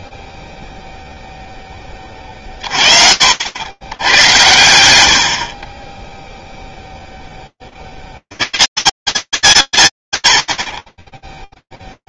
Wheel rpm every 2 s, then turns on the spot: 50, 30, 100, 0, 80, 90.
none